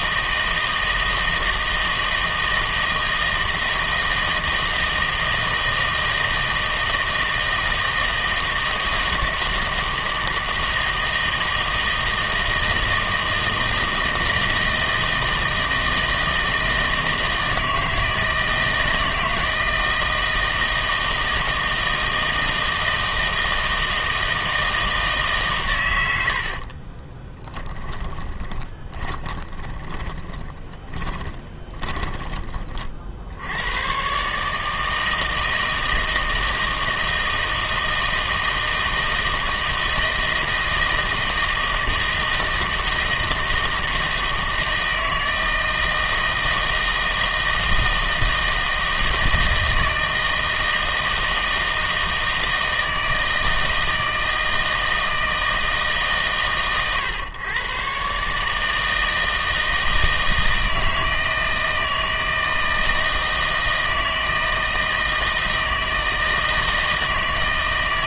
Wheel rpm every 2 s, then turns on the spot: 160, 160, 160, 160, 160, 160, 160, 160, 160, 160, 160, 160, 160, 60, 20, 20, 30, 150, 160, 160, 160, 160, 160, 160, 160, 160, 160, 160, 130, 150, 160, 160, 160, 160.
26-32